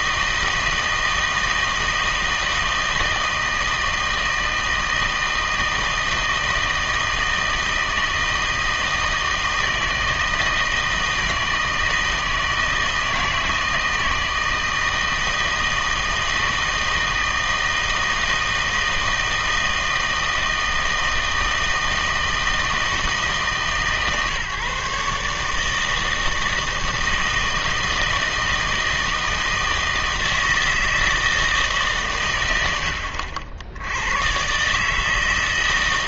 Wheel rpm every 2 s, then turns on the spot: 160, 160, 160, 160, 160, 160, 160, 160, 160, 160, 160, 160, 140, 160, 160, 160, 100, 140.
none